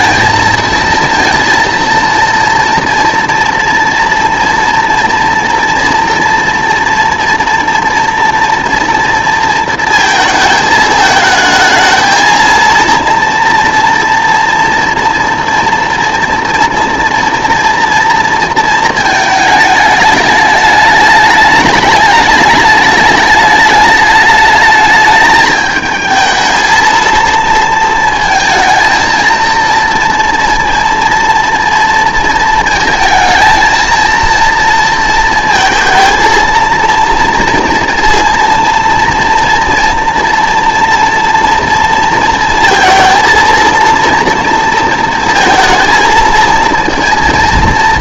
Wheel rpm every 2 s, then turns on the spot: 230, 230, 230, 240, 230, 220, 230, 240, 230, 230, 210, 210, 210, 230, 220, 240, 220, 230, 230, 230, 240, 230, 230, 230.
none